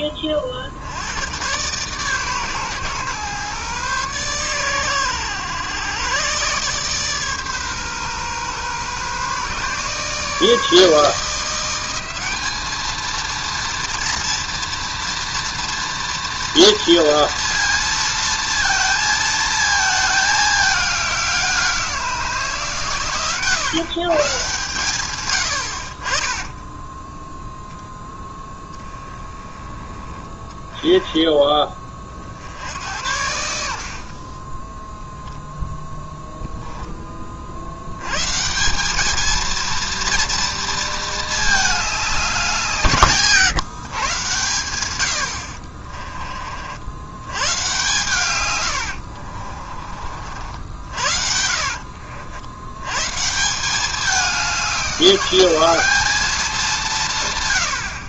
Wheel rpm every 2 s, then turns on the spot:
50, 130, 120, 140, 130, 160, 210, 230, 230, 230, 210, 150, 130, 10, 10, 10, 70, 10, 10, 180, 230, 180, 120, 60, 110, 70, 80, 190, 190.
48-52